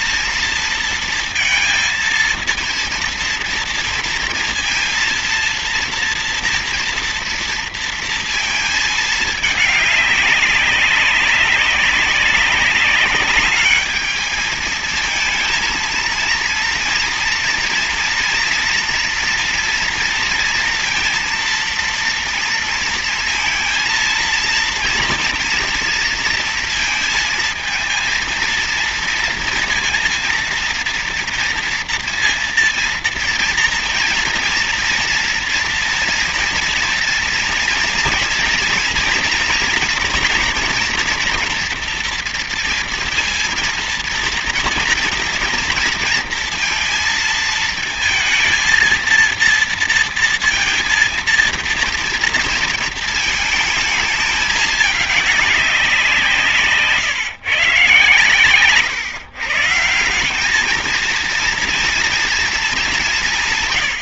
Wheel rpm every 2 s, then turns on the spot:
230, 230, 230, 230, 220, 190, 190, 220, 230, 230, 230, 230, 230, 230, 230, 230, 230, 230, 230, 230, 230, 230, 230, 230, 230, 230, 230, 210, 160, 120, 200, 230.
none